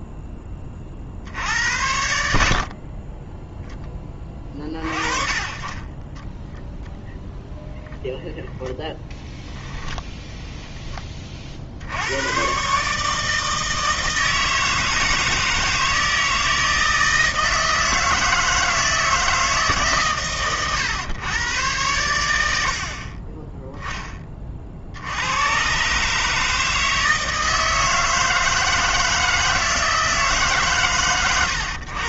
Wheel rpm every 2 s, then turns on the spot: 40, 40, 30, 0, 0, 10, 140, 160, 160, 160, 110, 50, 60, 160, 160, 140.
none